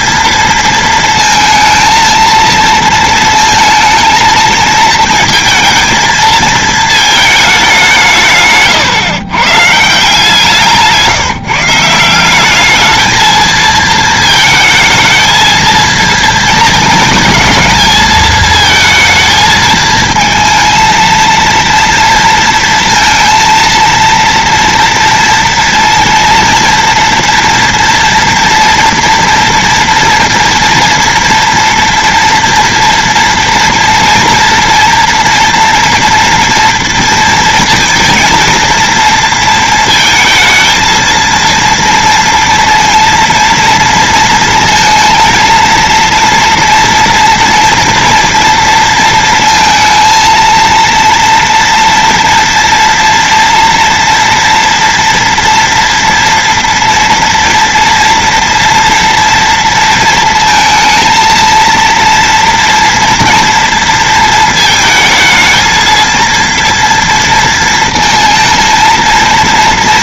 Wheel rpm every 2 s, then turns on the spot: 220, 230, 230, 220, 120, 170, 220, 220, 220, 220, 230, 230, 230, 230, 230, 230, 230, 230, 230, 230, 230, 230, 230, 230, 230, 230, 230, 230, 230, 240, 220, 230, 230, 230, 230.
none